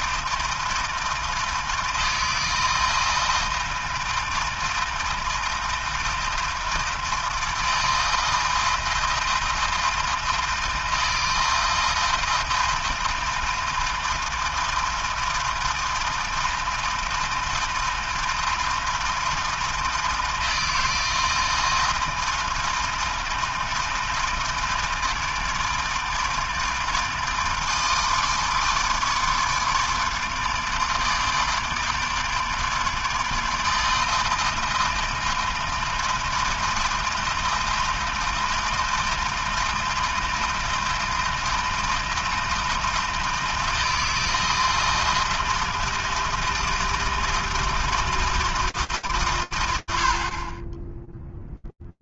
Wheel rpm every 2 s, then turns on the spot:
160, 160, 160, 160, 160, 160, 160, 160, 160, 160, 160, 160, 160, 160, 150, 150, 150, 160, 160, 160, 160, 160, 160, 160, 160, 20.
none